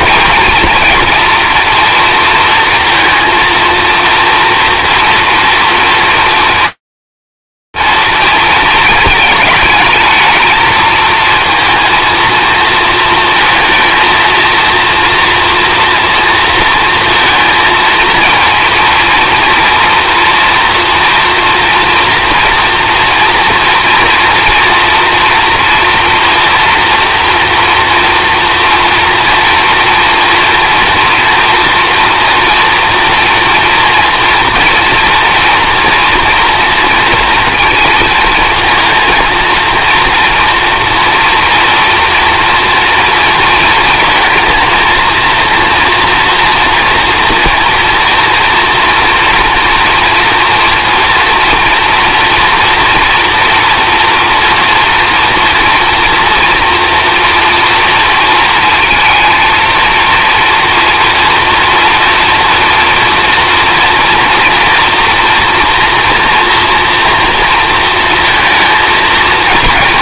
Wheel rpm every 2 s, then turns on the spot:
230, 230, 240, 230, 220, 230, 230, 230, 220, 230, 230, 230, 240, 230, 230, 230, 240, 230, 220, 230, 230, 230, 230, 230, 230, 230, 230, 230, 230, 230, 230, 230, 240, 230, 220.
none